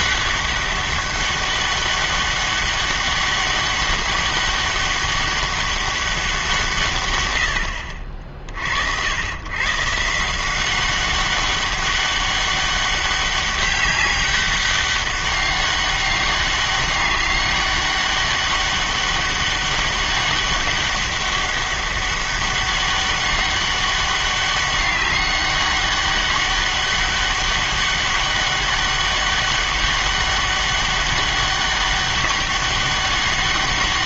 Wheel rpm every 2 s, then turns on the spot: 200, 200, 200, 160, 60, 180, 200, 190, 200, 200, 200, 200, 200, 200, 200, 200, 200.
none